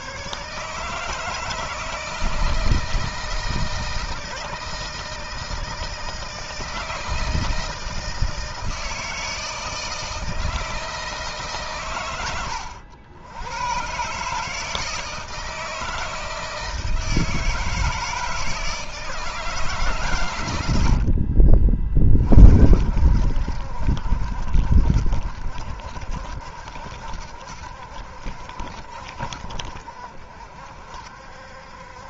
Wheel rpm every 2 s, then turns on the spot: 150, 160, 160, 160, 160, 160, 90, 160, 160, 160, 70, 60, 70, 70, 60, 60.
20-22